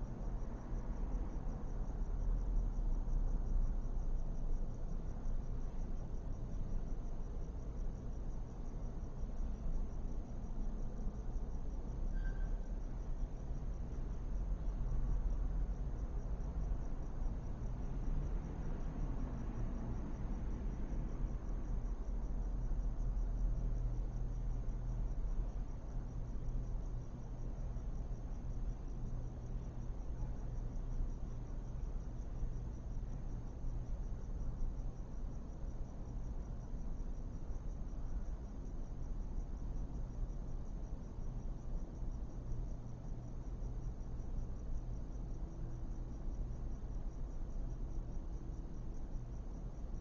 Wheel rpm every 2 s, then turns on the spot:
0, 0, 0, 0, 0, 0, 0, 0, 0, 0, 0, 0, 0, 0, 0, 0, 0, 0, 0, 0, 0, 0, 0, 0, 0.
none